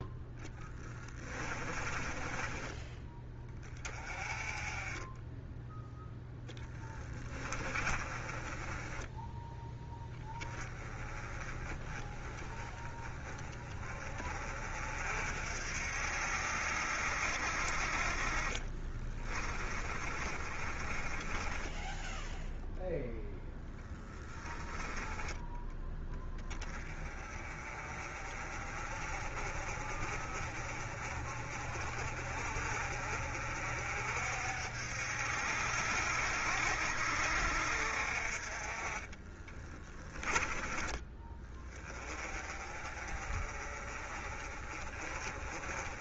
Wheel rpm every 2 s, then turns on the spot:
20, 10, 20, 20, 10, 20, 10, 50, 60, 30, 20, 10, 10, 20, 30, 30, 40, 60, 60, 30, 20, 30, 30.
0-2 6-8 18-22 38-40